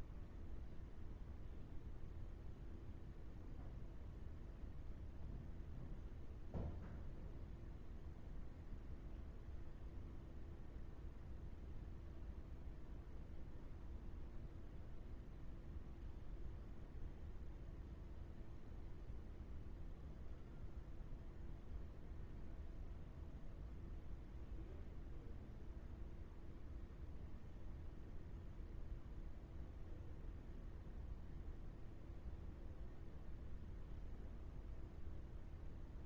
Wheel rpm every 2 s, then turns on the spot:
0, 0, 0, 0, 0, 0, 0, 0, 0, 0, 0, 0, 0, 0, 0, 0, 0, 0.
none